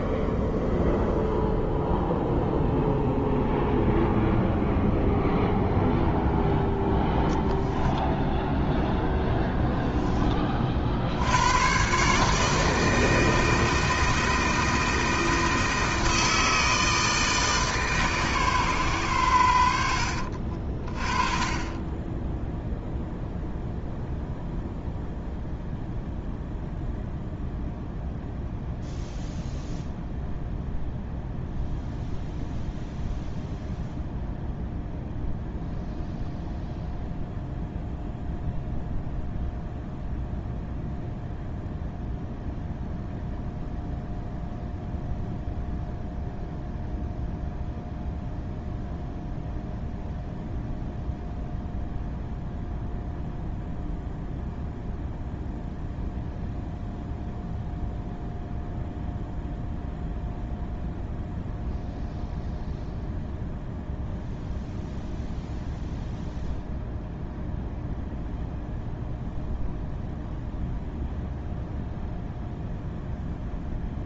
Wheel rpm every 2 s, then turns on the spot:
0, 0, 0, 0, 0, 60, 160, 160, 160, 120, 30, 0, 0, 0, 0, 0, 0, 0, 0, 0, 0, 0, 0, 0, 0, 0, 0, 0, 0, 0, 0, 0, 0, 0, 0, 0, 0.
none